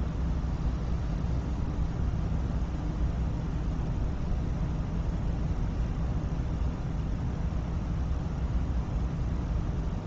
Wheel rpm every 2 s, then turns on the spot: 0, 0, 0, 0, 0.
none